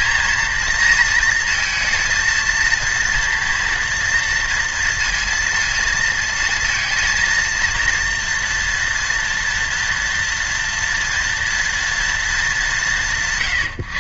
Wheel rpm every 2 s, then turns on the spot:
230, 230, 230, 230, 230, 240, 180.
none